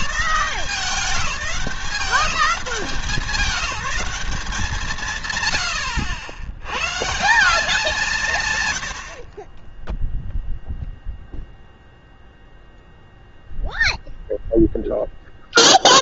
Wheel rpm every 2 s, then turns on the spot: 200, 190, 180, 110, 140, 0, 0, 0.
none